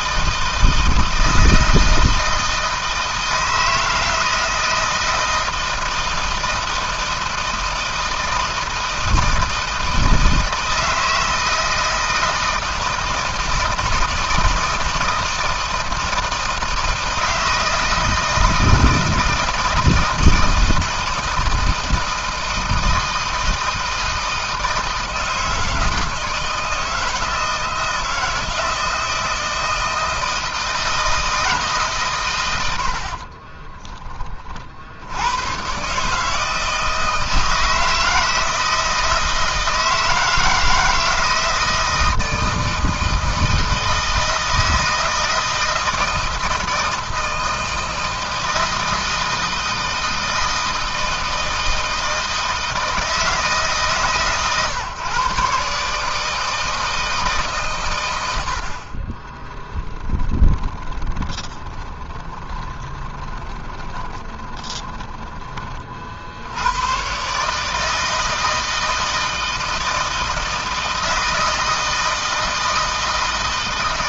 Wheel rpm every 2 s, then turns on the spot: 160, 160, 160, 160, 160, 160, 160, 160, 160, 160, 160, 160, 160, 160, 160, 160, 80, 60, 160, 160, 160, 160, 160, 160, 160, 160, 160, 140, 160, 60, 30, 20, 20, 100, 160, 160, 160.
58-66